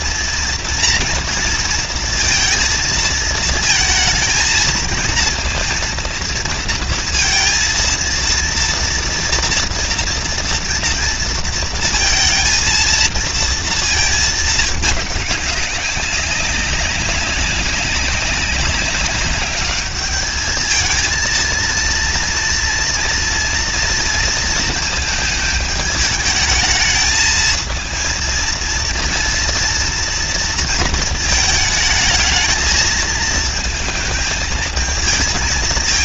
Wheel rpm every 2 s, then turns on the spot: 230, 230, 220, 230, 230, 230, 230, 230, 200, 200, 200, 230, 230, 220, 220, 230, 220, 220.
none